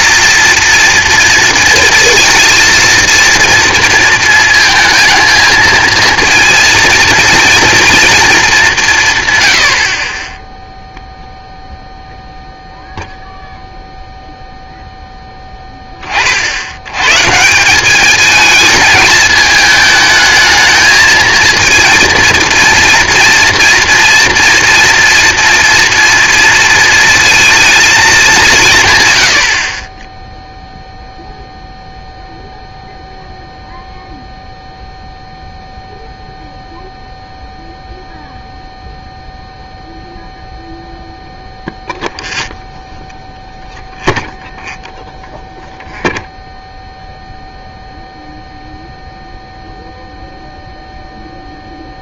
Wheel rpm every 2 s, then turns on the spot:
240, 230, 220, 230, 190, 0, 0, 0, 70, 220, 220, 230, 230, 230, 170, 0, 0, 0, 0, 0, 0, 0, 0, 0, 0, 0.
none